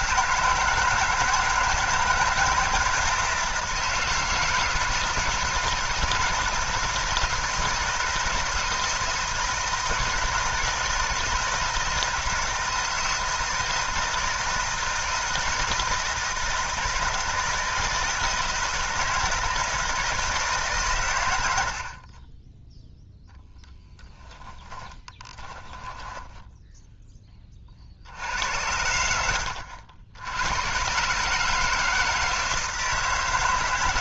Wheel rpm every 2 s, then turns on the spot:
170, 170, 160, 160, 160, 160, 160, 160, 160, 160, 150, 10, 10, 10, 90, 110, 160.
24-28